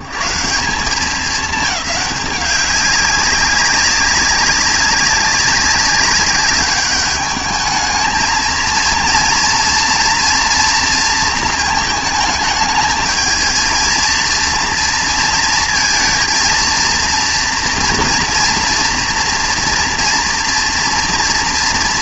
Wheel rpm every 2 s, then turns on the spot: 120, 200, 200, 200, 230, 230, 220, 230, 230, 230, 230.
none